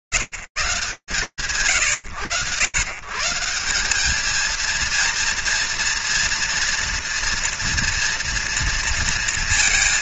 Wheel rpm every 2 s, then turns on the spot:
140, 100, 220, 230, 230.
none